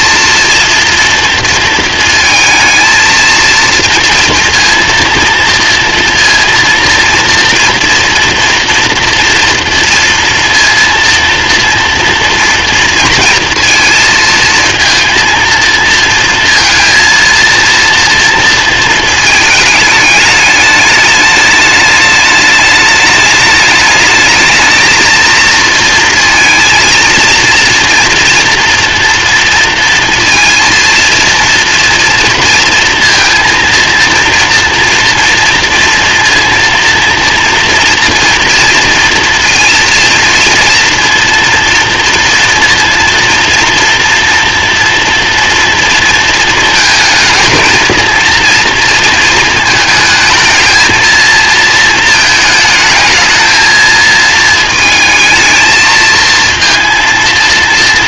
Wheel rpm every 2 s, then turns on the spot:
230, 230, 230, 230, 240, 230, 230, 230, 230, 230, 210, 210, 220, 230, 230, 230, 230, 230, 230, 230, 230, 230, 230, 220, 230, 220, 220, 220, 230.
none